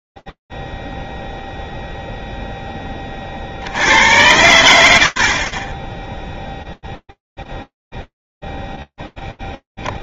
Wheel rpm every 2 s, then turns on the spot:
0, 0, 80, 0, 0.
none